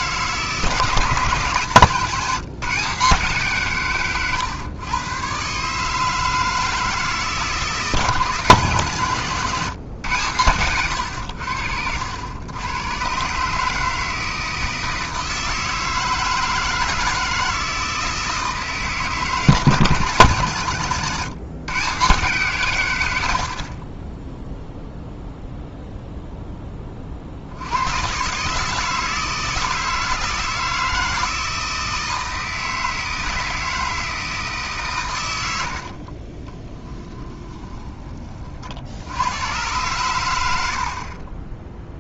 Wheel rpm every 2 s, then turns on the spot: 160, 160, 110, 160, 140, 100, 100, 160, 160, 160, 110, 120, 0, 20, 150, 160, 160, 150, 30, 60, 70.
36-38